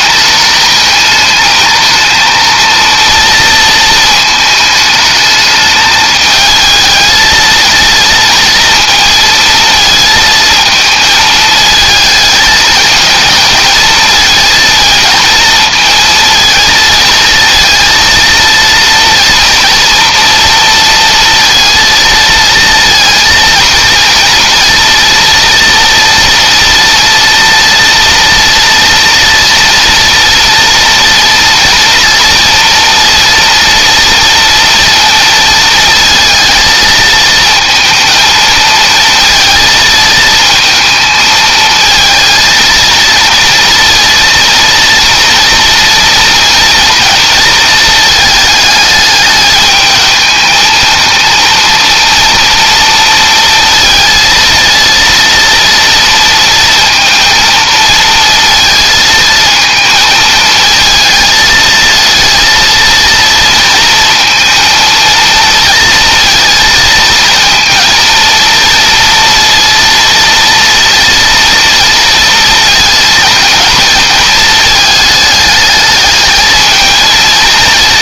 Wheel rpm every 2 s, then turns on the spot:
220, 230, 220, 220, 230, 220, 220, 230, 220, 230, 230, 230, 230, 230, 230, 230, 230, 230, 220, 230, 220, 230, 230, 230, 210, 220, 230, 230, 230, 220, 220, 230, 230, 230, 230, 230, 220, 210, 220.
none